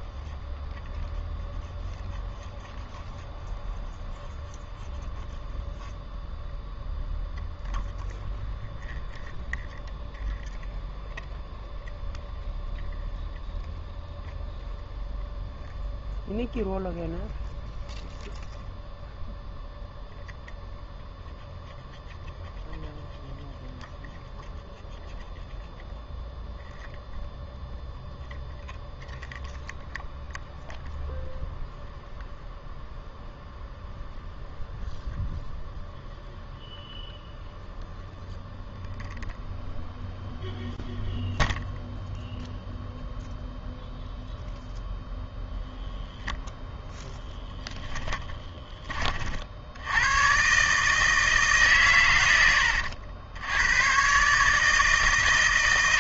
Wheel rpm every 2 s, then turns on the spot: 0, 0, 0, 0, 0, 0, 0, 0, 0, 0, 0, 0, 0, 0, 0, 0, 0, 0, 0, 0, 0, 0, 10, 10, 30, 150, 90, 150.
46-48